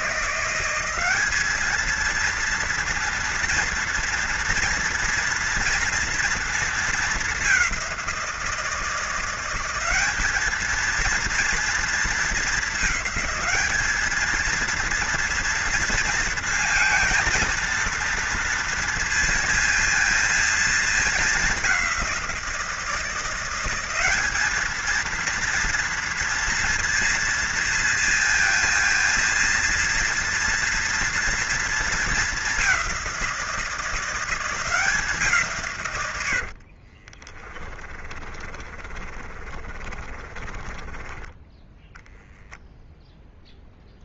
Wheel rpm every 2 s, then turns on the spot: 190, 230, 240, 220, 170, 230, 210, 230, 230, 230, 220, 170, 220, 230, 230, 240, 190, 180, 40, 30, 20, 0.
36-42